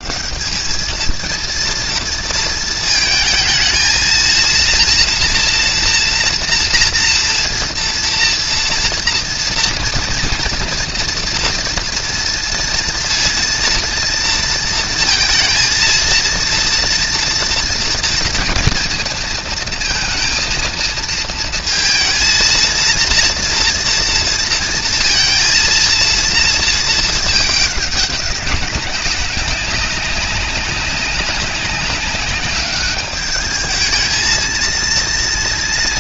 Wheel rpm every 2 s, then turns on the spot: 190, 220, 230, 230, 230, 230, 230, 230, 230, 230, 230, 230, 230, 230, 190, 190, 200, 220.
none